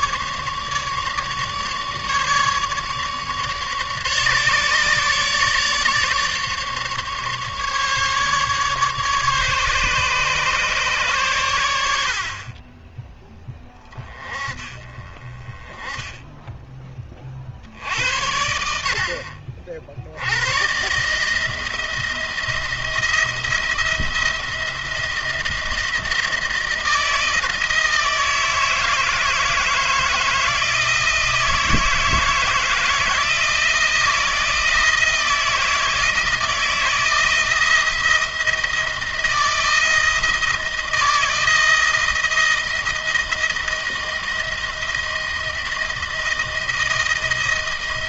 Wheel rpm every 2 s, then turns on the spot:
150, 150, 150, 150, 140, 140, 30, 30, 20, 80, 110, 170, 170, 160, 160, 160, 160, 160, 160, 160, 160, 170, 170, 160.
none